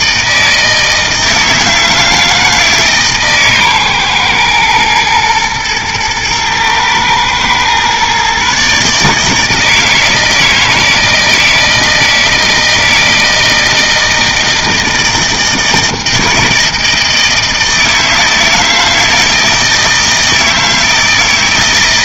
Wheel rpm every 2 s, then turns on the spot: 160, 160, 120, 110, 150, 160, 160, 160, 160, 160, 160.
none